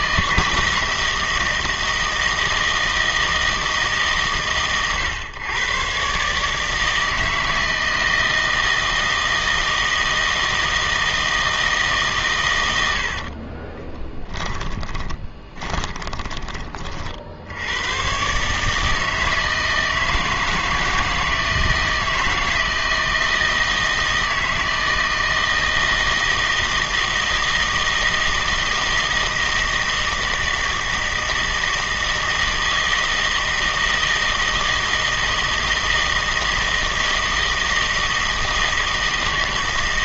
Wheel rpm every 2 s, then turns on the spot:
160, 160, 120, 160, 160, 160, 90, 20, 30, 150, 160, 160, 160, 160, 160, 160, 160, 160, 160, 160.
14-16